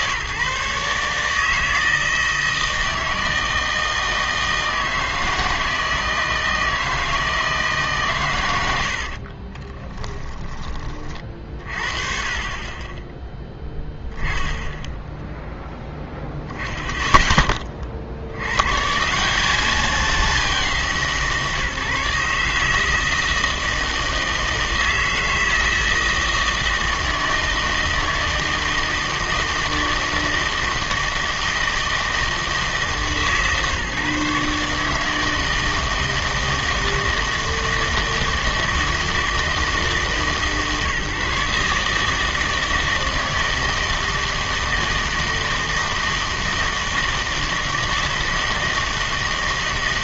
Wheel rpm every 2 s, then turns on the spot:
150, 160, 160, 160, 100, 30, 30, 10, 10, 110, 190, 160, 160, 160, 160, 160, 150, 150, 160, 160, 150, 160, 160, 160, 160.
none